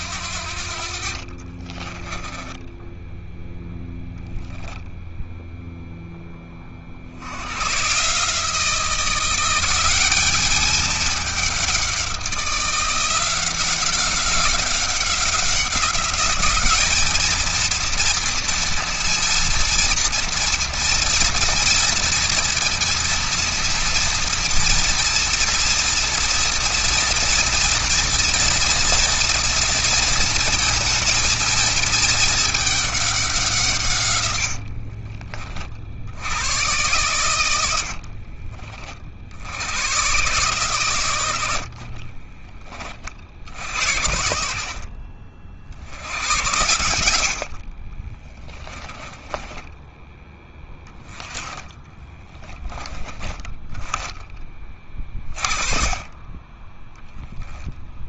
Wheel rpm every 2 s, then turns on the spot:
50, 10, 10, 60, 170, 200, 180, 190, 220, 230, 230, 230, 240, 230, 230, 230, 200, 50, 110, 60, 110, 40, 50, 90, 10, 10, 10, 30, 10.
0-2 34-36 48-52 56-58